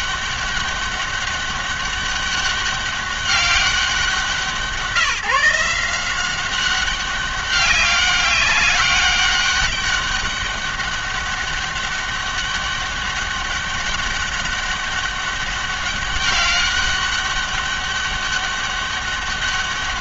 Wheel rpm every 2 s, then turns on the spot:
200, 200, 170, 190, 200, 200, 200, 200, 200, 200.
none